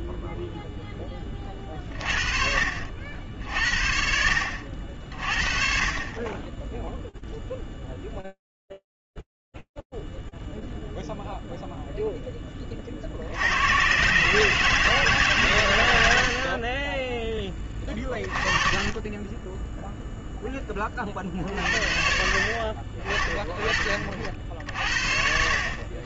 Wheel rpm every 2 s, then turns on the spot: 0, 60, 70, 10, 0, 10, 150, 50, 20, 0, 50, 40, 60.
none